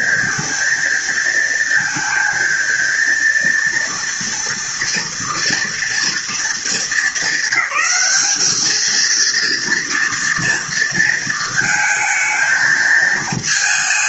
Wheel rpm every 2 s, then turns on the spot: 230, 230, 230, 200, 220, 230, 220.
none